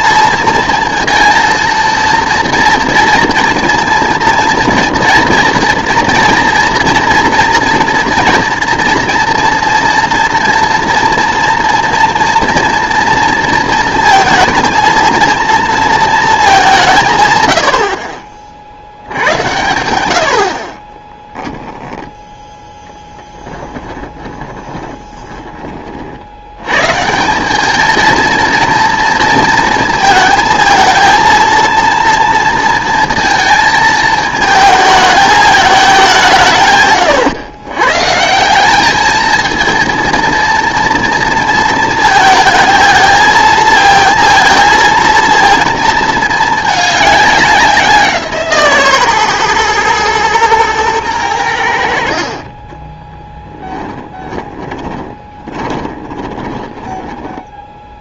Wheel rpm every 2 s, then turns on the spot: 230, 230, 230, 230, 240, 230, 230, 220, 190, 60, 40, 10, 20, 100, 230, 230, 230, 210, 160, 180, 230, 220, 220, 220, 160, 110, 30, 20, 20.
24-26 52-58